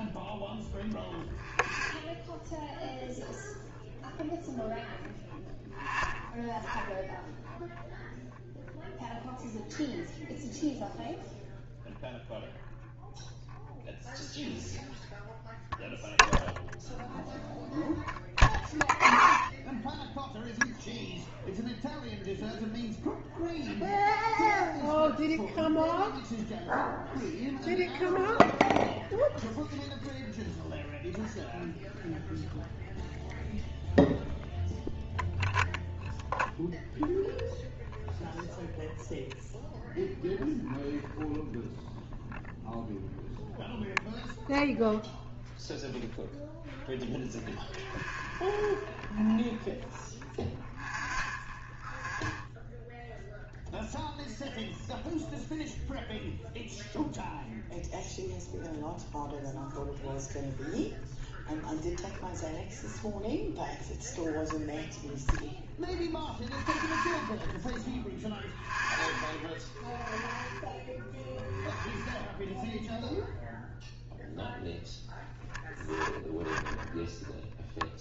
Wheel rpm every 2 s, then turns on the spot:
0, 0, 0, 0, 0, 0, 0, 0, 0, 0, 0, 0, 0, 0, 0, 0, 0, 0, 0, 0, 0, 0, 0, 0, 0, 0, 0, 0, 0, 0, 0, 0, 0, 0, 0, 0, 0, 0, 0.
none